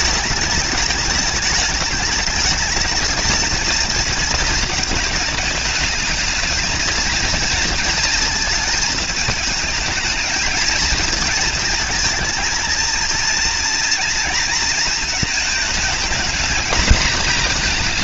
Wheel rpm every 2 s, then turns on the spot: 220, 210, 220, 220, 230, 220, 220, 230, 220.
none